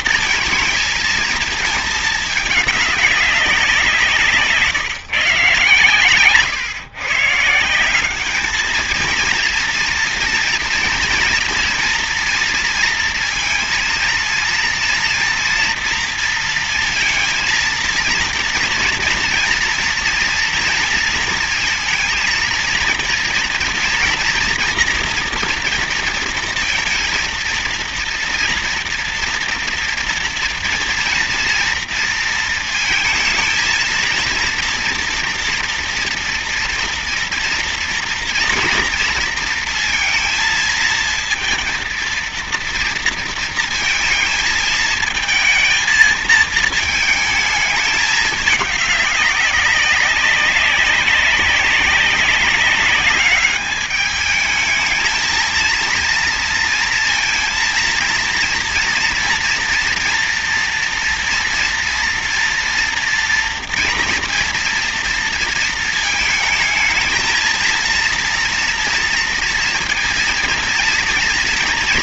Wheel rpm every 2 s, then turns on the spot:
230, 210, 150, 140, 220, 240, 230, 230, 230, 230, 230, 230, 240, 230, 230, 240, 230, 230, 230, 230, 230, 230, 220, 220, 200, 200, 200, 220, 230, 230, 230, 230, 230, 220, 230, 230.
none